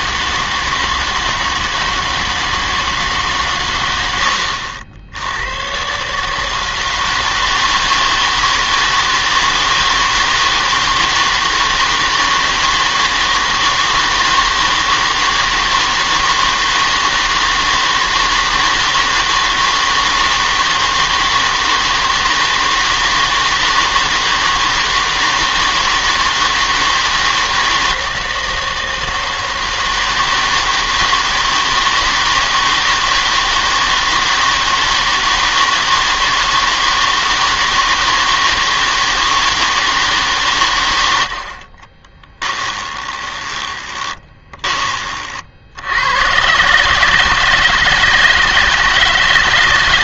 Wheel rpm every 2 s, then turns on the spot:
160, 160, 70, 160, 160, 160, 160, 160, 160, 160, 160, 160, 160, 160, 160, 160, 160, 160, 160, 160, 120, 20, 20, 130, 160.
42-44